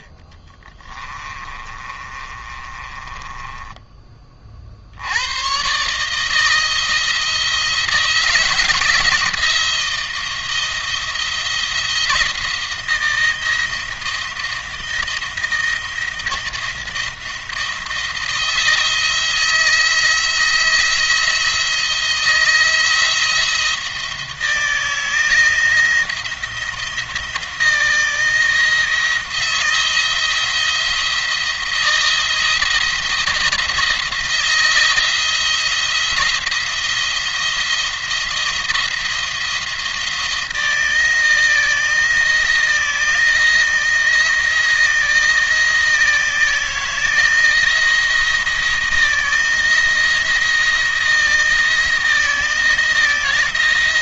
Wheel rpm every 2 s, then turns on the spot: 20, 20, 60, 160, 160, 170, 170, 160, 170, 160, 170, 170, 170, 170, 160, 170, 170, 160, 170, 170, 160, 160, 170, 170, 160, 170, 160.
0-4